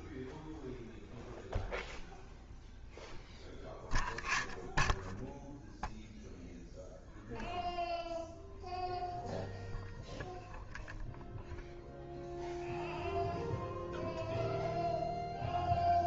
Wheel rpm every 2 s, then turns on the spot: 0, 0, 0, 0, 0, 0, 0, 0.
none